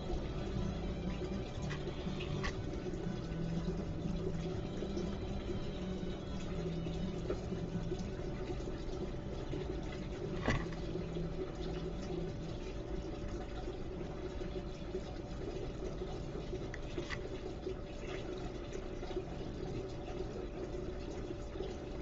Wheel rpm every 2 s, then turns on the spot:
0, 0, 0, 0, 0, 0, 0, 0, 0, 0, 0.
none